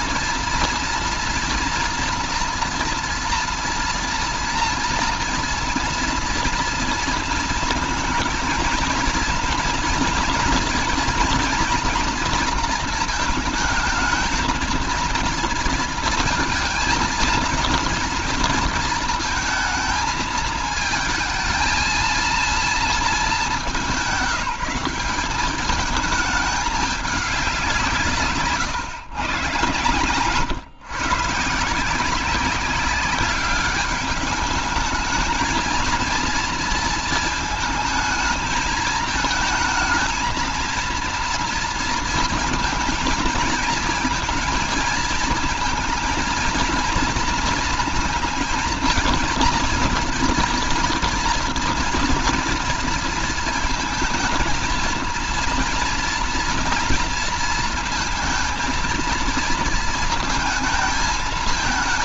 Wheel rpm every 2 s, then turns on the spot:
230, 230, 230, 230, 230, 230, 220, 230, 230, 230, 220, 220, 190, 200, 120, 140, 190, 210, 230, 220, 230, 230, 230, 230, 230, 230, 240, 220, 230, 220, 220.
none